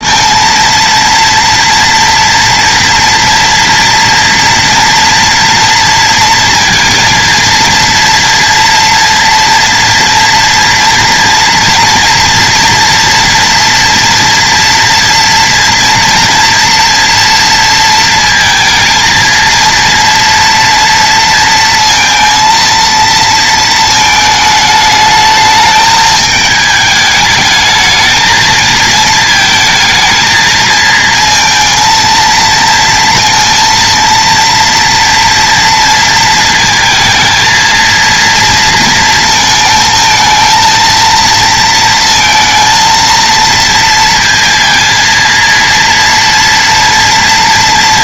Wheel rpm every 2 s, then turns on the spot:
230, 240, 240, 230, 230, 230, 230, 240, 230, 230, 230, 230, 220, 220, 220, 220, 230, 230, 220, 230, 230, 230, 230, 230.
none